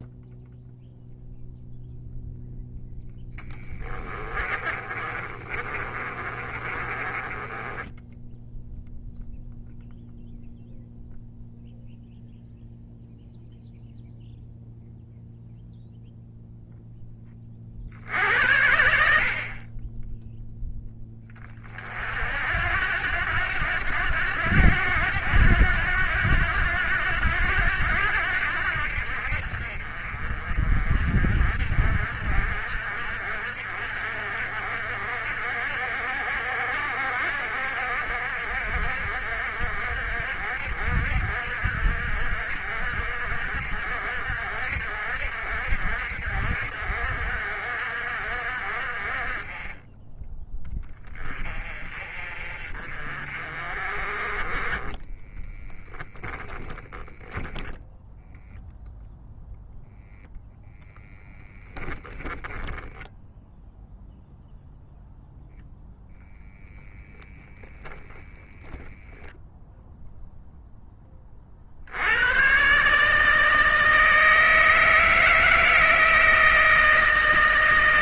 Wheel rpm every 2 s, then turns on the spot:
0, 0, 40, 30, 0, 0, 0, 0, 10, 80, 10, 80, 90, 90, 70, 50, 50, 60, 60, 60, 60, 60, 60, 60, 40, 10, 40, 20, 10, 0, 0, 10, 0, 0, 0, 10, 130, 160, 160.
4-8 56-58 62-64